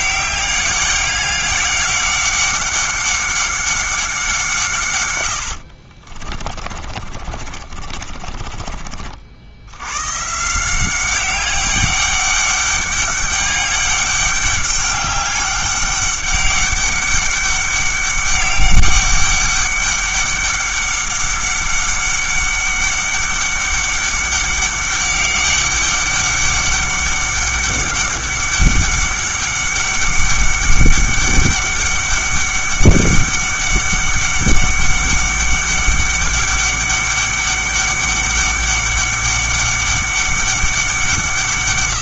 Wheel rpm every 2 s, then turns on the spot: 200, 200, 140, 30, 30, 170, 200, 200, 200, 200, 200, 200, 200, 200, 200, 200, 200, 200, 200, 200, 190.
6-10